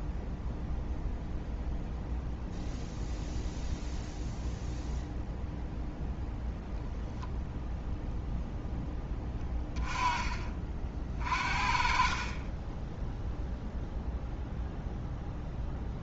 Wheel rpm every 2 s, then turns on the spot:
0, 0, 0, 0, 10, 40, 10, 0.
12-14